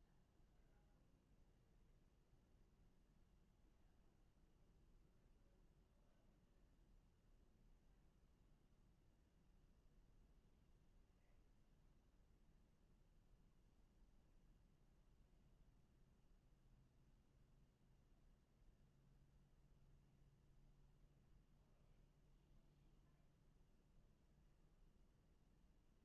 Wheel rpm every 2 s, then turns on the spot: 0, 0, 0, 0, 0, 0, 0, 0, 0, 0, 0, 0, 0.
none